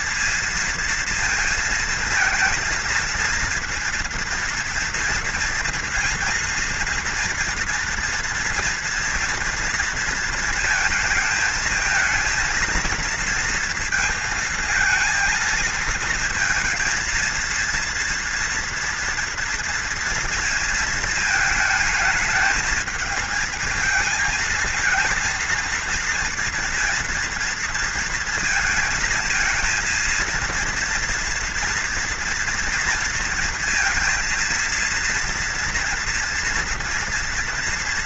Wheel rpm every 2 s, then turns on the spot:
230, 230, 230, 230, 230, 220, 230, 230, 230, 230, 230, 220, 230, 230, 230, 230, 230, 230, 240.
none